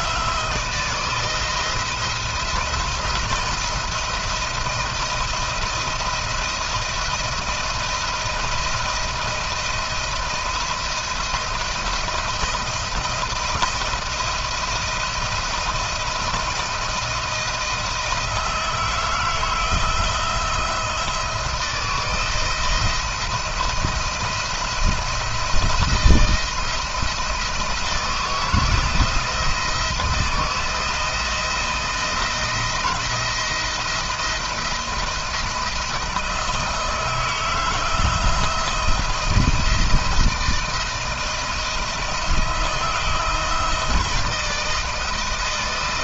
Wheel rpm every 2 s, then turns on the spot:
160, 170, 170, 170, 170, 170, 170, 170, 170, 160, 170, 170, 170, 170, 170, 160, 170, 170, 160, 170, 160, 160, 160.
none